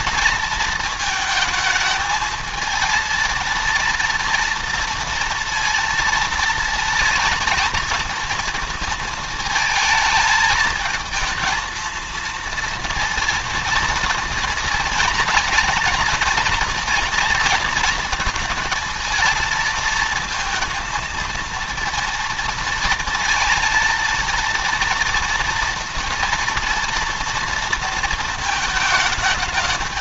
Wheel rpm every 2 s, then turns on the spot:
220, 220, 230, 230, 230, 220, 230, 230, 230, 230, 220, 230, 230, 230, 220.
none